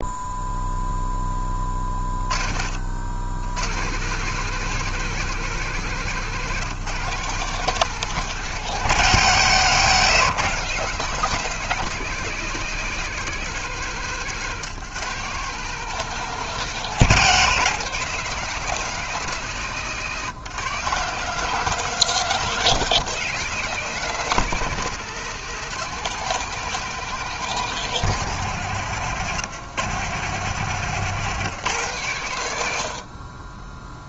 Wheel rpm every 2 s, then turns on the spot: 0, 50, 160, 150, 160, 150, 160, 140, 160, 160, 140, 170, 150, 160, 150, 140, 110.
none